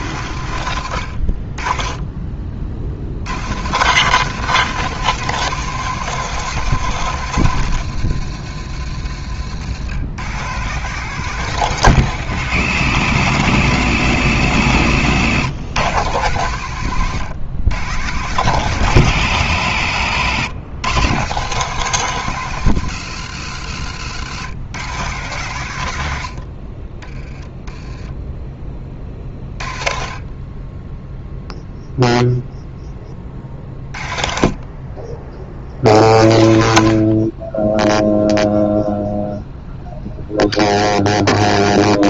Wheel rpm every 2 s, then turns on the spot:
100, 40, 160, 160, 100, 140, 130, 120, 120, 150, 130, 130, 110, 60, 20, 20, 0, 30, 70, 0, 0.
none